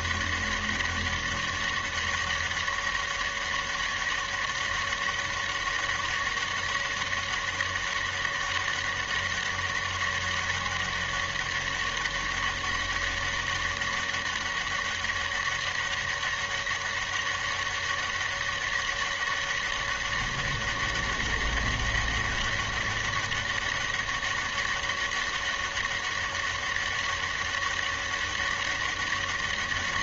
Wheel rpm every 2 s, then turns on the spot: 200, 200, 200, 200, 200, 200, 200, 200, 200, 200, 200, 200, 200, 200, 200.
none